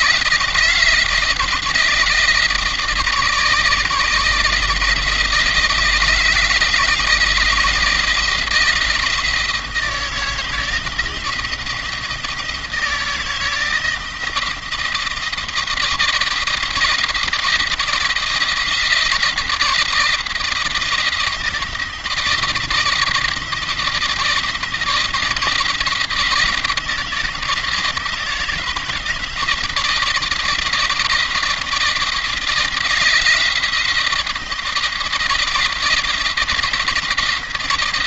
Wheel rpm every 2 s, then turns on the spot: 170, 160, 160, 170, 170, 170, 160, 170, 170, 160, 170, 170, 160, 170, 160, 160, 160, 170, 170.
none